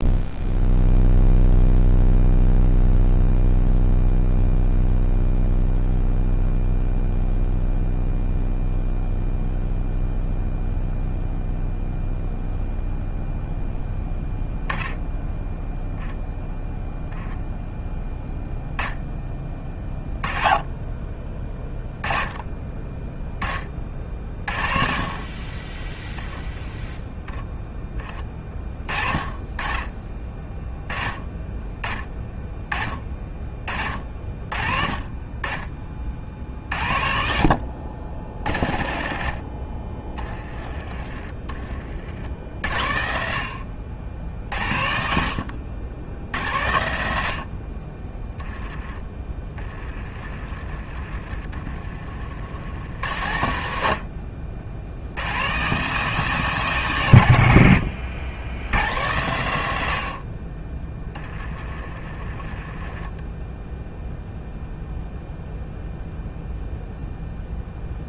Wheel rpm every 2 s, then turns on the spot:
0, 0, 0, 0, 0, 0, 0, 10, 0, 10, 20, 20, 40, 10, 30, 20, 30, 40, 60, 60, 30, 60, 70, 80, 20, 40, 90, 90, 140, 110, 20, 20, 0, 0.
50-52 60-64